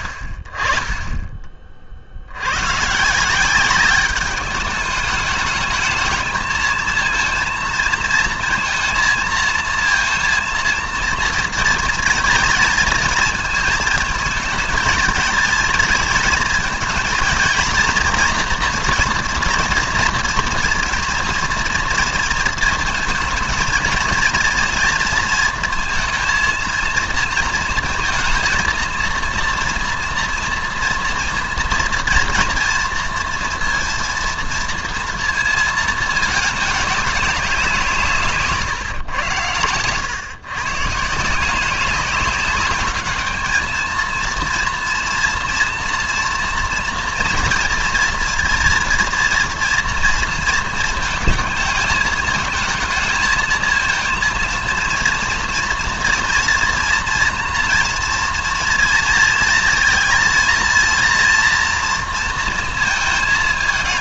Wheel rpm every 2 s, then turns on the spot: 20, 100, 210, 220, 230, 230, 230, 230, 230, 230, 230, 230, 230, 230, 230, 230, 230, 230, 210, 150, 140, 200, 230, 240, 230, 230, 220, 230, 230, 230, 230, 230.
none